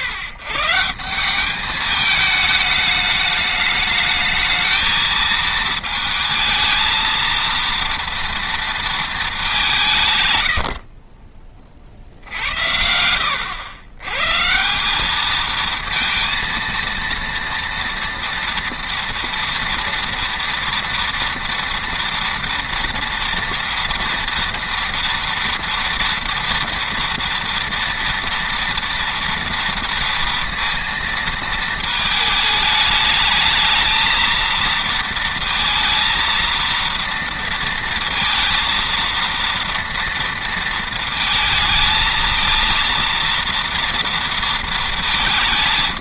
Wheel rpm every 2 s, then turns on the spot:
130, 210, 220, 220, 230, 60, 90, 190, 230, 230, 230, 230, 230, 230, 230, 230, 210, 230, 230, 230, 230, 230, 220.
10-12